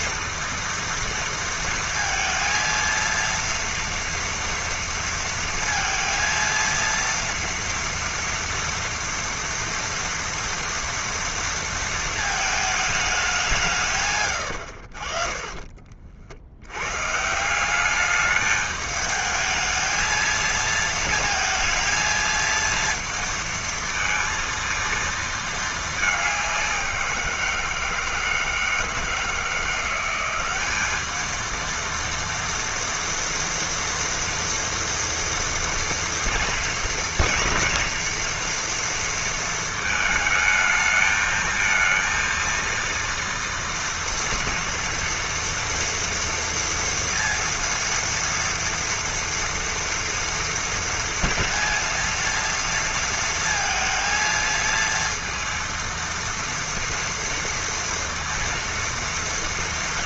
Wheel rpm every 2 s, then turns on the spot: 230, 230, 230, 230, 230, 230, 200, 40, 140, 210, 220, 230, 230, 180, 160, 210, 230, 240, 230, 230, 220, 230, 230, 230, 230, 230, 230, 230, 230, 230.
none